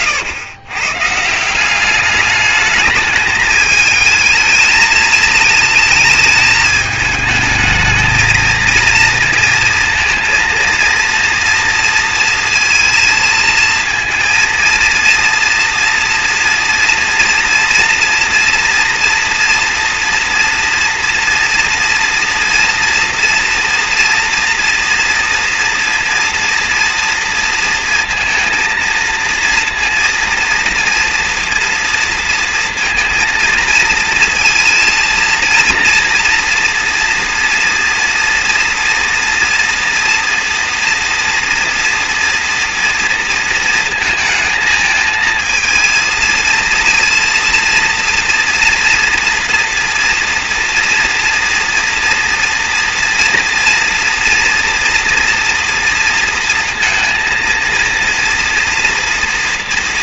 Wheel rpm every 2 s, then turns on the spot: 120, 210, 220, 220, 220, 230, 230, 230, 230, 240, 230, 230, 230, 230, 230, 230, 230, 230, 230, 240, 230, 230, 220, 230, 230, 230, 230, 240, 230, 230.
none